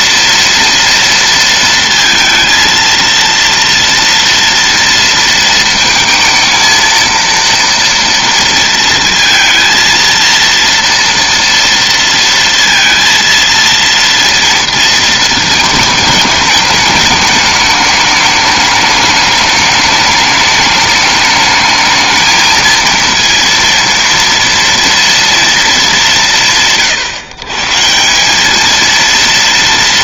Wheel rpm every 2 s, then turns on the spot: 230, 230, 230, 230, 230, 230, 230, 220, 210, 210, 210, 230, 230, 140, 230.
none